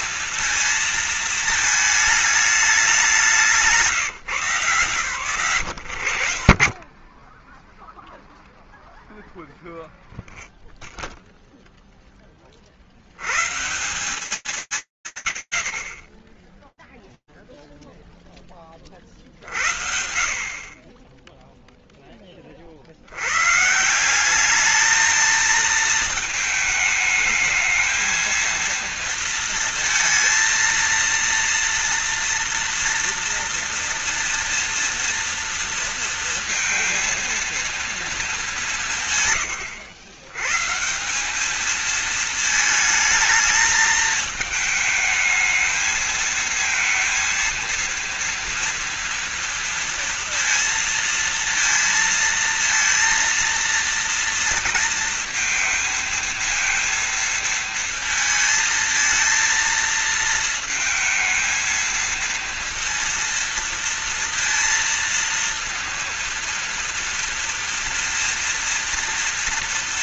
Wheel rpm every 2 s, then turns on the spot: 230, 210, 140, 50, 0, 0, 30, 120, 0, 20, 30, 70, 220, 220, 230, 230, 230, 230, 230, 150, 180, 220, 220, 230, 230, 230, 220, 230, 230, 230, 220, 230, 230, 230, 230.
6-8